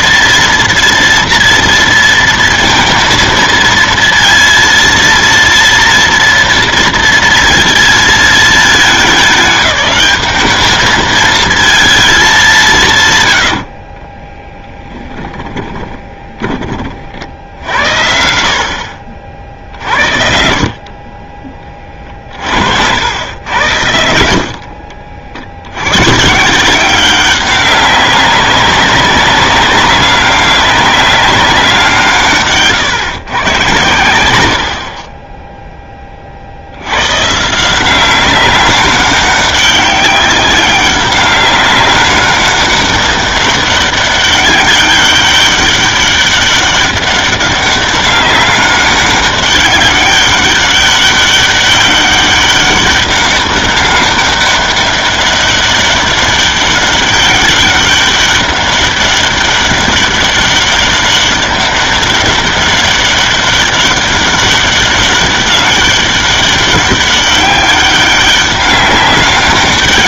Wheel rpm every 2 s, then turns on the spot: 230, 230, 230, 230, 220, 210, 170, 10, 30, 60, 50, 60, 60, 170, 200, 200, 140, 80, 60, 200, 190, 200, 200, 200, 200, 200, 200, 200, 200, 200, 200, 200, 200, 200, 200.
14-18